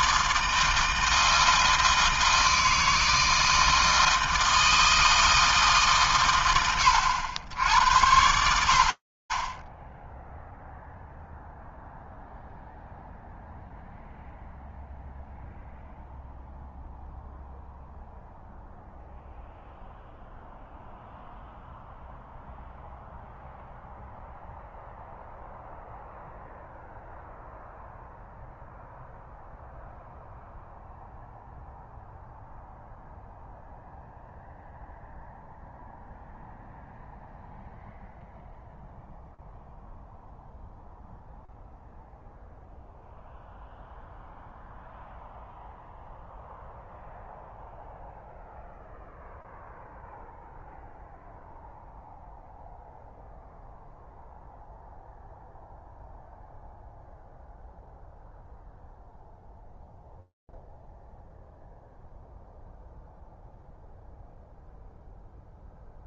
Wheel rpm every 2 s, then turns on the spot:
160, 160, 160, 120, 70, 0, 0, 0, 0, 0, 0, 0, 0, 0, 0, 0, 0, 0, 0, 0, 0, 0, 0, 0, 0, 0, 0, 0, 0, 0, 0, 0, 0.
none